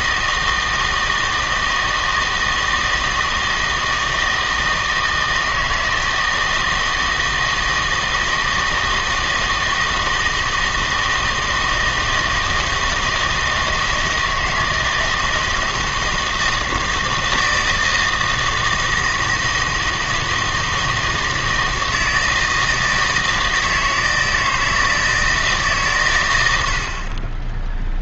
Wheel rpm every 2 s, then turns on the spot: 160, 160, 160, 160, 160, 160, 160, 160, 160, 160, 160, 160, 160, 70.
26-28